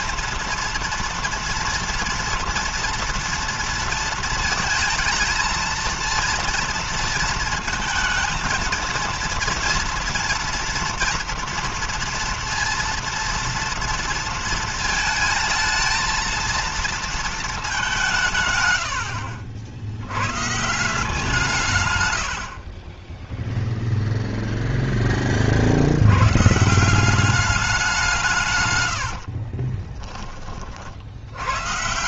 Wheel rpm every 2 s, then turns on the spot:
230, 230, 220, 230, 220, 230, 230, 230, 230, 130, 140, 70, 0, 140, 150, 30.
28-30